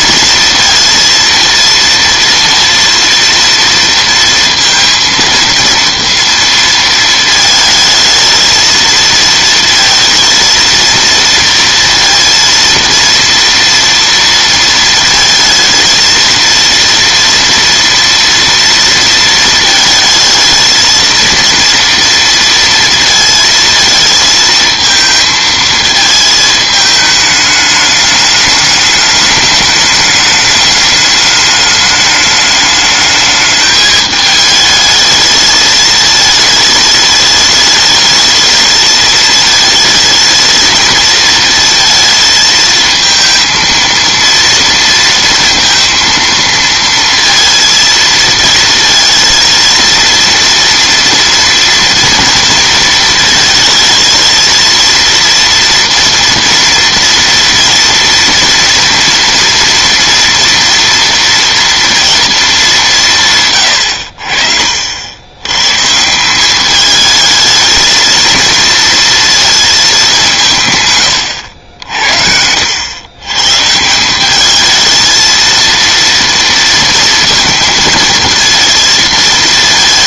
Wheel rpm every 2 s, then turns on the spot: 230, 230, 230, 230, 230, 230, 230, 220, 230, 230, 230, 230, 220, 220, 210, 210, 220, 220, 210, 220, 220, 220, 230, 230, 230, 230, 220, 230, 230, 230, 240, 190, 60, 210, 230, 130, 100, 220, 230, 230.
none